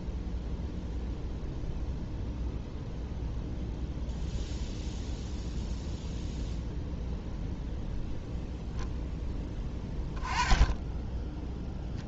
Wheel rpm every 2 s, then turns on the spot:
0, 0, 0, 0, 0, 10.
none